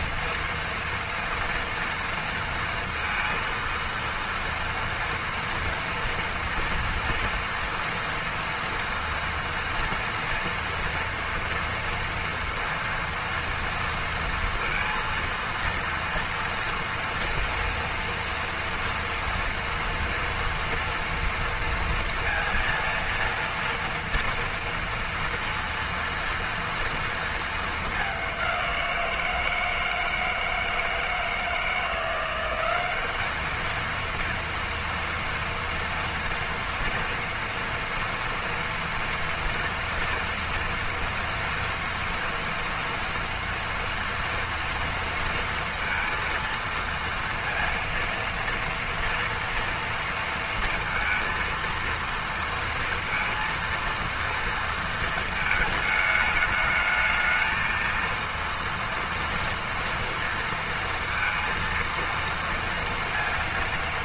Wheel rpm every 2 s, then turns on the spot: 230, 230, 230, 230, 230, 230, 230, 230, 230, 230, 230, 230, 230, 230, 180, 160, 190, 230, 230, 230, 230, 230, 230, 230, 230, 230, 230, 230, 210, 230, 230, 230.
none